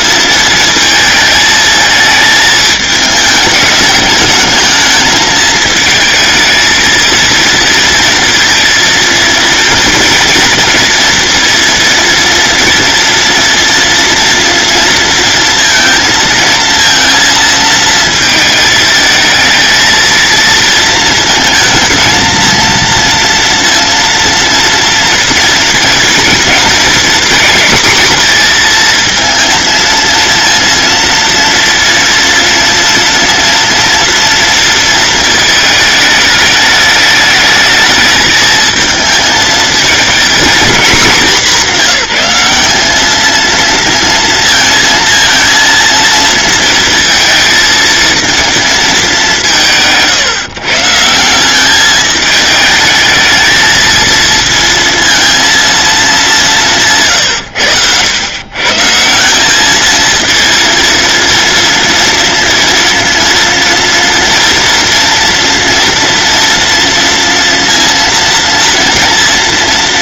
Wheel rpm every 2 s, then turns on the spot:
220, 220, 220, 220, 230, 230, 230, 230, 230, 220, 230, 230, 240, 230, 230, 230, 230, 220, 210, 220, 200, 210, 230, 230, 210, 150, 220, 230, 150, 150, 230, 230, 230, 230, 230.
none